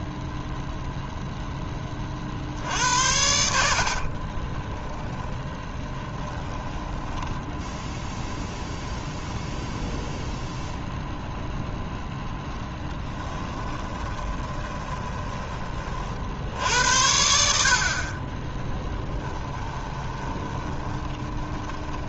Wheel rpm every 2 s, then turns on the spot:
0, 80, 10, 10, 0, 0, 10, 20, 80, 10, 20.
4-8 12-16 18-22